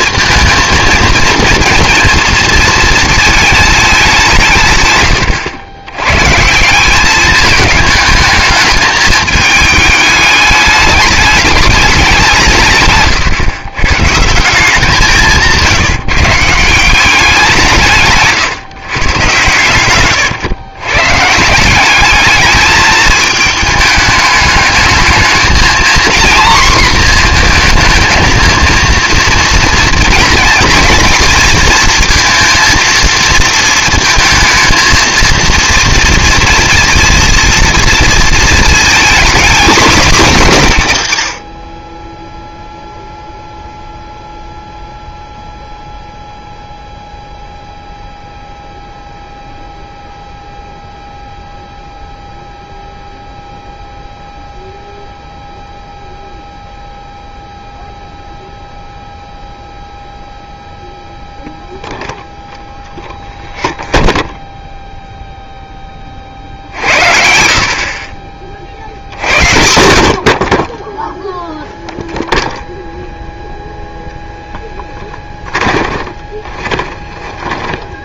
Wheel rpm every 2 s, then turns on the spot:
230, 230, 140, 180, 210, 210, 140, 180, 170, 130, 130, 220, 220, 240, 230, 230, 230, 230, 230, 220, 160, 0, 0, 0, 0, 0, 0, 0, 0, 0, 0, 0, 0, 70, 50, 20, 0, 10, 30.
74-78